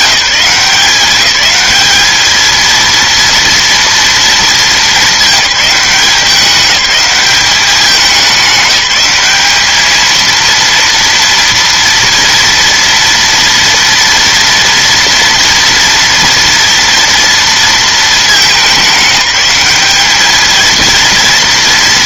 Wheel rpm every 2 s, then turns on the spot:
190, 230, 210, 190, 200, 230, 230, 230, 230, 210, 230.
none